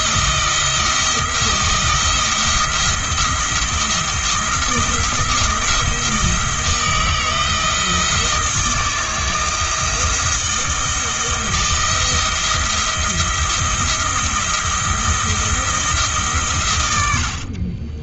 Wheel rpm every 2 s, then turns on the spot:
170, 170, 170, 160, 160, 160, 170, 170, 100.
none